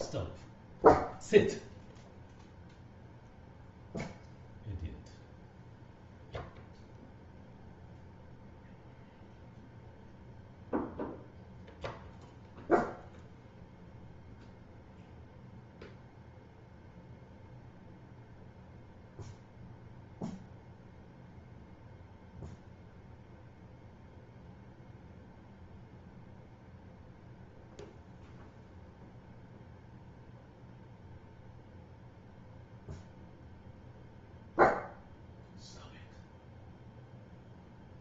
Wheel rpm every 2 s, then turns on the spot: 0, 0, 0, 0, 0, 0, 0, 0, 0, 0, 0, 0, 0, 0, 0, 0, 0, 0, 0.
none